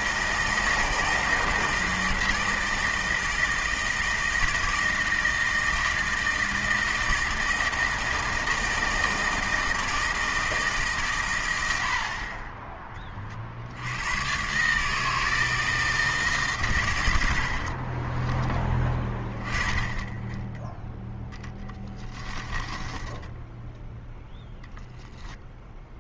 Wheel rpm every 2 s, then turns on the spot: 160, 160, 160, 160, 160, 150, 20, 140, 130, 20, 10, 20, 10.
22-24